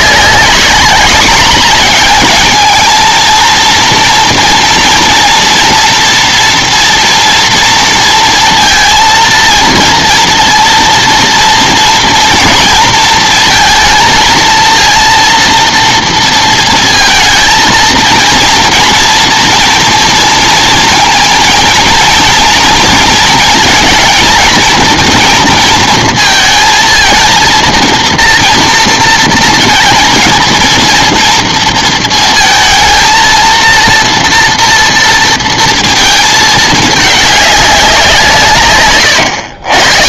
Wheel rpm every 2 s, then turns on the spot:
200, 220, 230, 230, 230, 230, 230, 230, 230, 230, 230, 230, 230, 230, 230, 230, 230, 240, 220, 160.
none